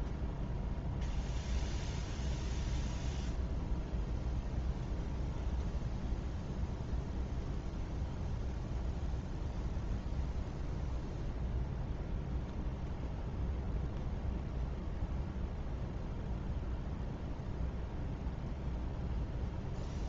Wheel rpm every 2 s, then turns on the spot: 0, 0, 0, 0, 0, 0, 0, 0, 0, 0.
none